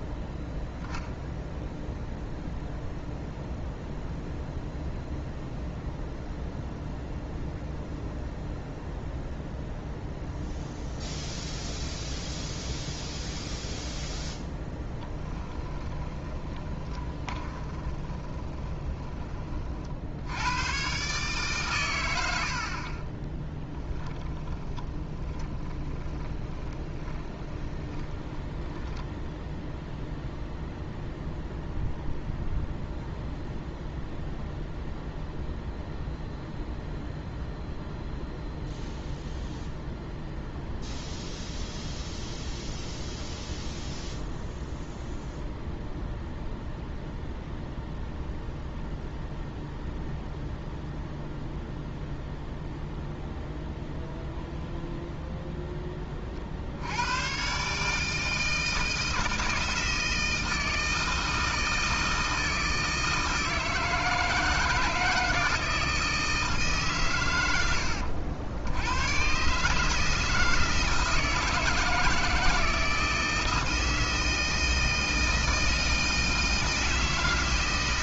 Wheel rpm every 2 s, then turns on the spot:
0, 0, 0, 0, 0, 0, 0, 10, 20, 20, 110, 50, 10, 20, 20, 0, 0, 0, 0, 0, 0, 0, 0, 0, 0, 0, 0, 0, 70, 160, 160, 160, 170, 150, 90, 160, 170, 160, 160.
14-20 24-30